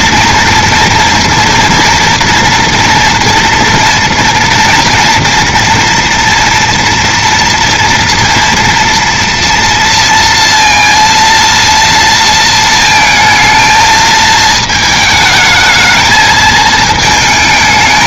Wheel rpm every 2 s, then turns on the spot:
230, 230, 240, 230, 230, 230, 230, 220, 220.
none